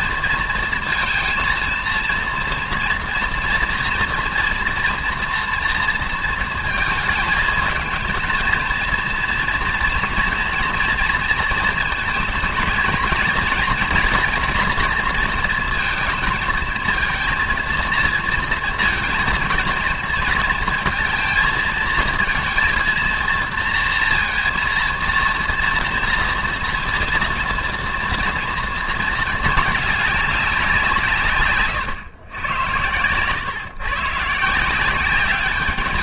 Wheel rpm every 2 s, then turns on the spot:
230, 230, 230, 230, 220, 230, 230, 230, 220, 230, 220, 230, 230, 230, 230, 190, 100, 150.
none